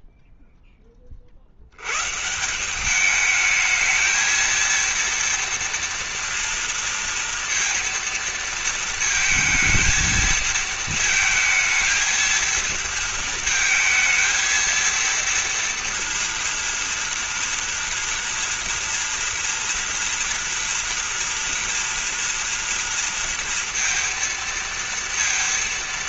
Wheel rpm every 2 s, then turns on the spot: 0, 150, 220, 230, 230, 220, 230, 220, 230, 230, 230, 230, 230.
none